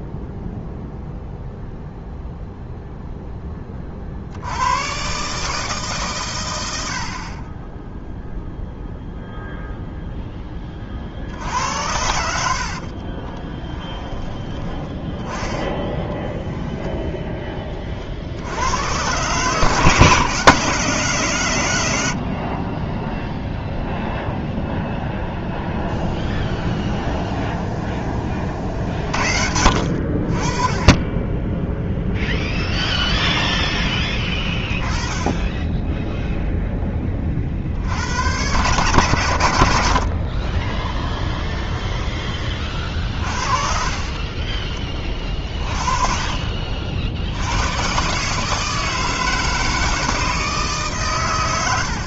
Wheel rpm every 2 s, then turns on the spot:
0, 0, 110, 90, 0, 30, 50, 20, 0, 110, 160, 20, 0, 0, 50, 20, 0, 20, 20, 110, 10, 30, 30, 40, 150, 140.
12-16